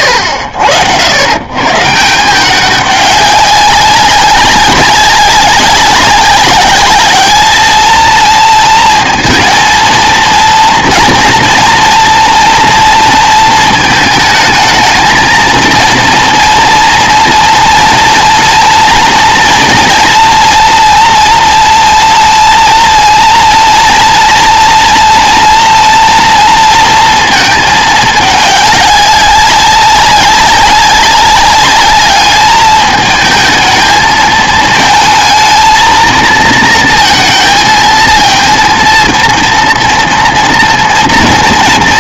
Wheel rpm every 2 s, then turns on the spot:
70, 190, 200, 200, 230, 230, 230, 220, 230, 230, 230, 230, 230, 230, 200, 200, 210, 220, 230, 230, 230.
none